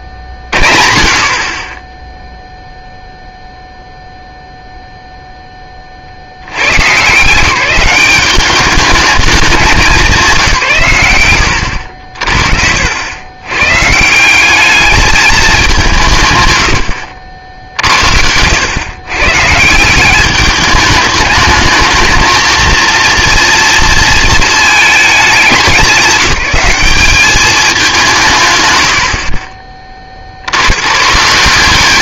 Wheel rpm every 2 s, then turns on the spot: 40, 0, 0, 140, 210, 150, 60, 210, 110, 110, 210, 230, 220, 200, 100, 110.
none